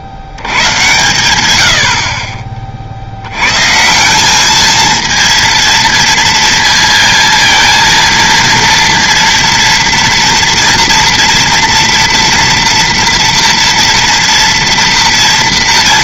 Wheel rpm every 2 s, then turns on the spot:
110, 40, 220, 230, 230, 240, 230, 230.
0-2